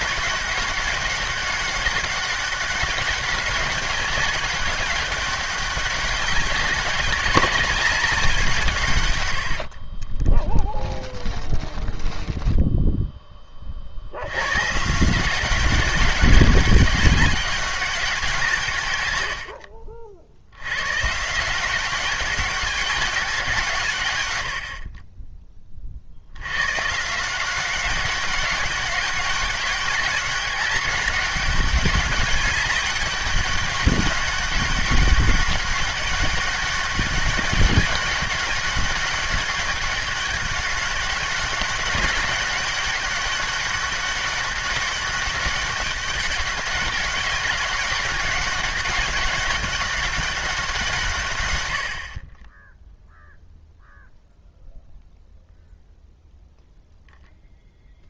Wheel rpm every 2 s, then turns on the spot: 200, 200, 200, 200, 170, 20, 10, 150, 200, 130, 130, 200, 60, 130, 200, 200, 200, 190, 200, 200, 200, 200, 200, 190, 200, 170, 10, 0, 0.
10-12